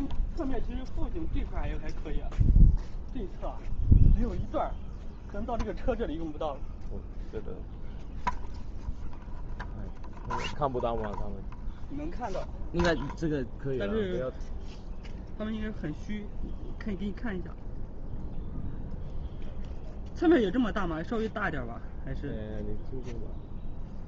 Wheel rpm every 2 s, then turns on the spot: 0, 0, 0, 0, 0, 0, 0, 0, 0, 0, 0, 0.
none